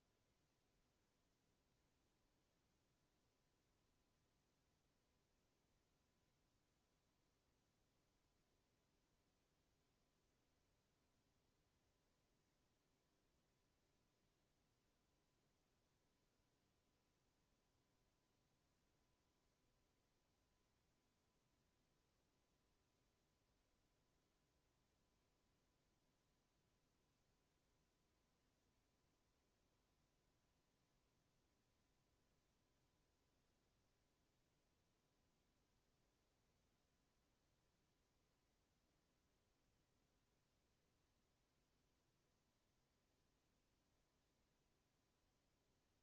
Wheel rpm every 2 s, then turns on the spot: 0, 0, 0, 0, 0, 0, 0, 0, 0, 0, 0, 0, 0, 0, 0, 0, 0, 0, 0, 0, 0, 0, 0.
none